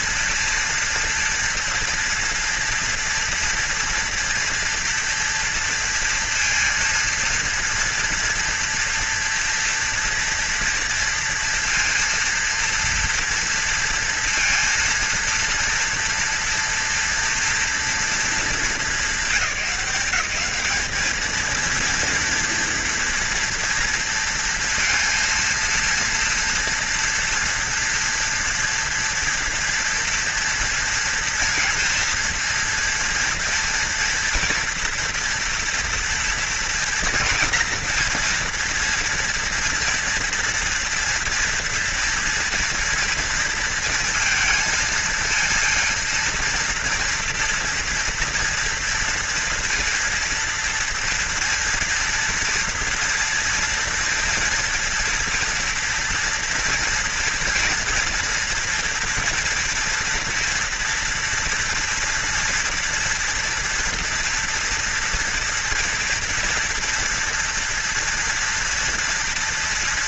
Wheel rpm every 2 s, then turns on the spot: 230, 230, 230, 230, 230, 230, 230, 230, 230, 210, 200, 230, 230, 240, 230, 240, 230, 230, 240, 230, 230, 230, 230, 230, 240, 230, 230, 230, 230, 230, 230, 240, 240, 230, 230.
none